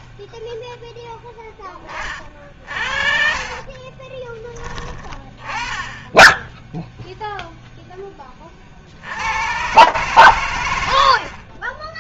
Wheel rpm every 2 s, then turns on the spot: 0, 50, 20, 0, 40, 80.
none